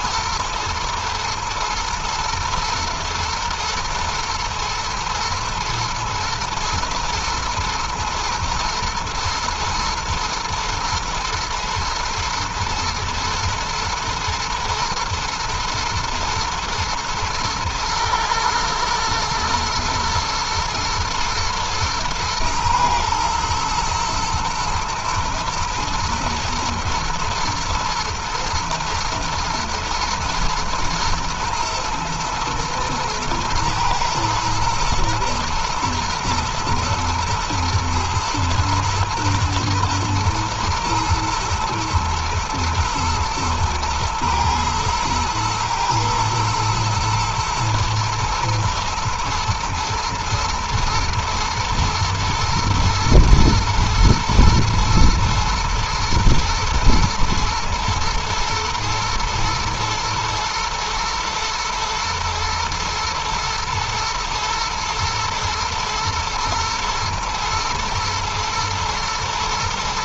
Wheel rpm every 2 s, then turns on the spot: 120, 120, 110, 120, 120, 120, 110, 120, 120, 110, 120, 110, 110, 110, 110, 110, 110, 110, 110, 120, 120, 120, 120, 110, 110, 110, 110, 110, 120, 110, 120, 120, 110, 110, 110.
none